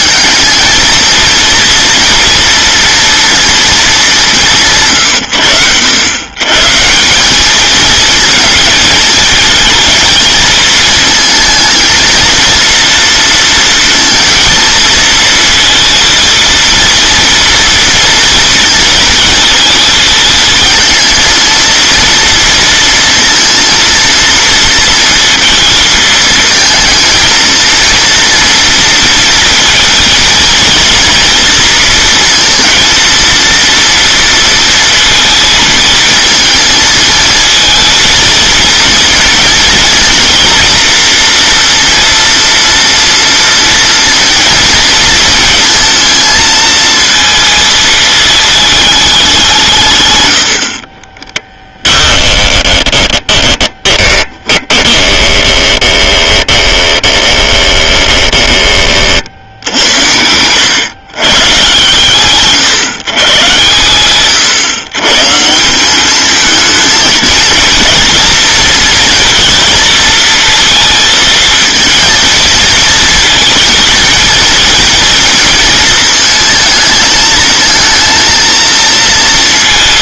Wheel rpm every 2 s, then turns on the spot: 230, 240, 130, 160, 220, 220, 230, 220, 230, 230, 220, 230, 220, 220, 230, 230, 230, 230, 230, 230, 240, 230, 230, 230, 210, 40, 10, 20, 20, 20, 110, 140, 120, 220, 230, 230, 230, 230, 220, 230.
52-58